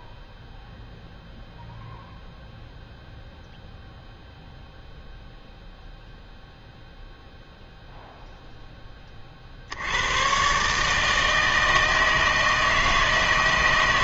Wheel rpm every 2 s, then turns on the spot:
0, 0, 0, 0, 10, 150, 160.
none